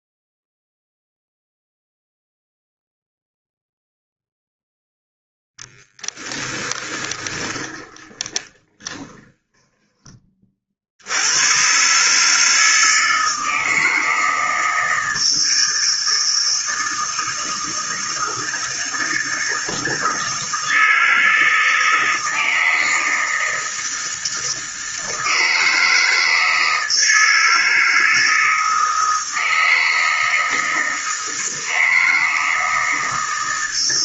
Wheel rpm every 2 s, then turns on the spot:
0, 0, 0, 10, 20, 50, 160, 160, 160, 160, 160, 160, 160, 160, 160, 160, 160.
6-10